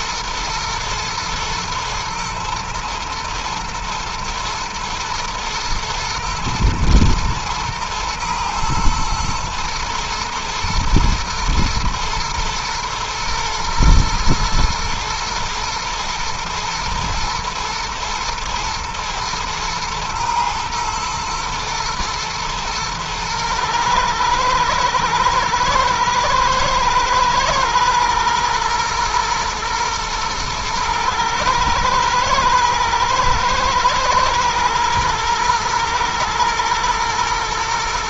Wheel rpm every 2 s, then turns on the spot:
110, 110, 110, 110, 120, 120, 120, 120, 110, 110, 120, 120, 110, 110, 120, 110, 120, 120, 110.
none